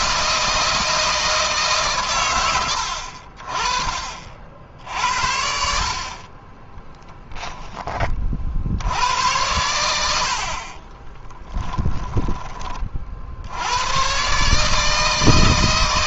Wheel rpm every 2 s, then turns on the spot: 160, 70, 70, 10, 70, 30, 40, 160.
6-8 10-12